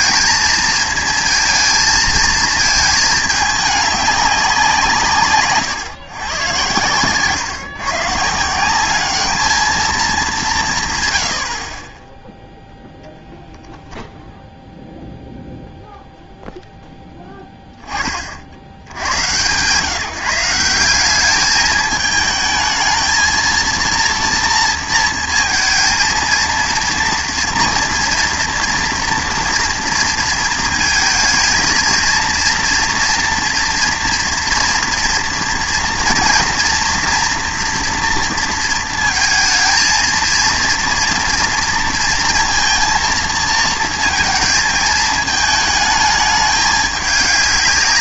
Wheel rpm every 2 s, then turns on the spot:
230, 220, 170, 110, 180, 160, 0, 0, 0, 70, 180, 220, 230, 230, 230, 220, 230, 230, 230, 230, 230, 230, 220, 210.
none